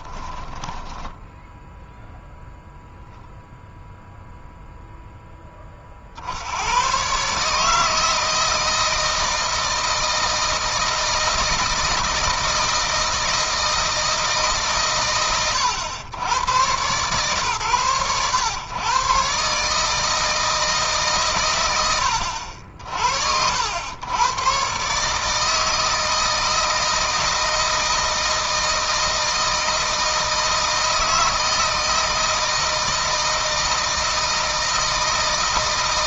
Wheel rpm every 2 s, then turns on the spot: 10, 0, 0, 110, 160, 160, 160, 140, 110, 120, 150, 60, 130, 160, 160, 160, 160, 160.
0-2